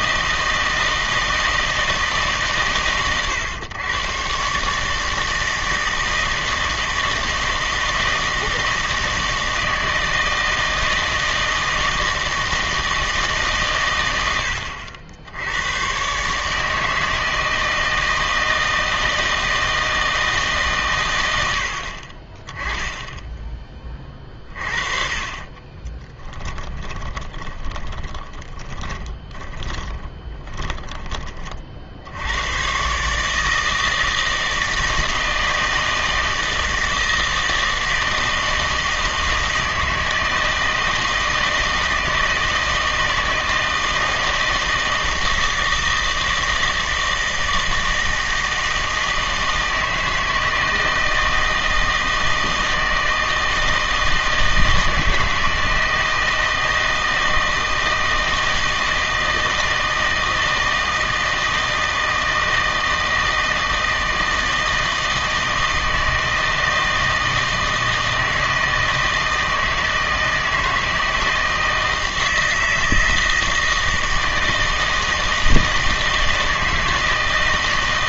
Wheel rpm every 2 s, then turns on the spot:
160, 140, 140, 160, 160, 160, 160, 80, 150, 160, 150, 20, 40, 10, 20, 30, 110, 160, 160, 160, 160, 160, 160, 160, 160, 160, 160, 160, 160, 160, 160, 160, 160, 160, 160, 160, 160, 160, 160.
24-32